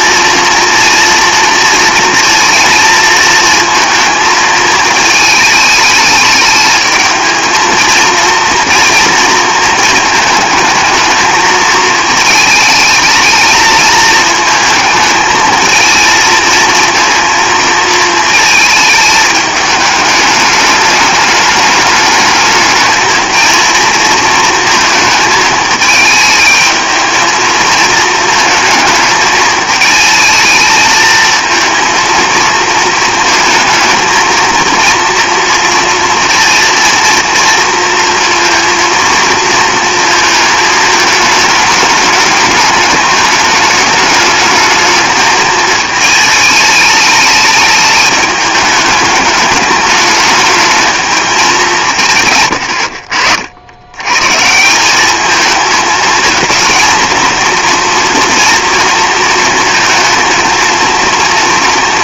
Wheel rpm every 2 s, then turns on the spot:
230, 230, 220, 220, 230, 220, 220, 220, 230, 220, 210, 210, 220, 220, 220, 220, 230, 230, 230, 230, 220, 210, 210, 220, 210, 220, 110, 150, 230, 230, 230.
none